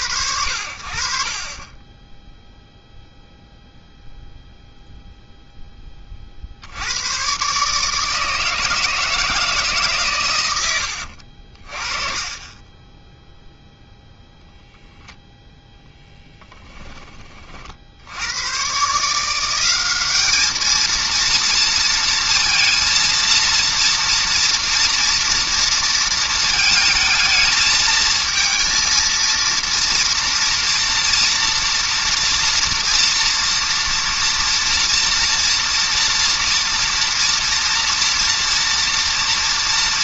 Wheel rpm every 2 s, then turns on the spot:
20, 0, 0, 140, 150, 60, 0, 0, 40, 180, 230, 230, 230, 220, 230, 230, 230, 230, 230, 240.
none